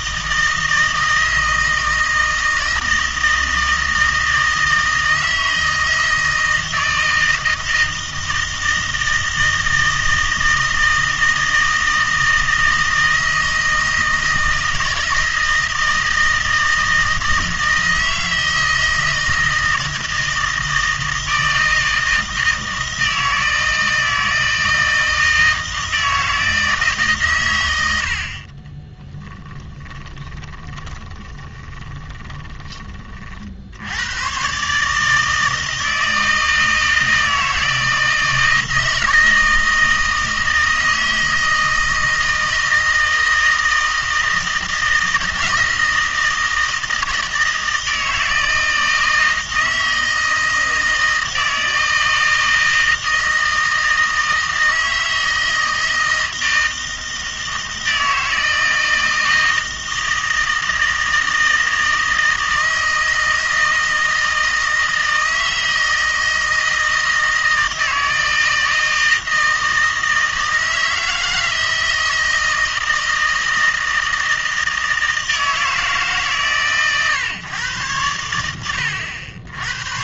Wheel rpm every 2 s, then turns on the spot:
160, 160, 160, 160, 160, 160, 160, 160, 160, 160, 160, 160, 160, 160, 30, 20, 20, 140, 160, 160, 160, 160, 160, 160, 160, 160, 160, 160, 160, 160, 160, 160, 160, 160, 160, 160, 160, 160, 130, 90.
28-32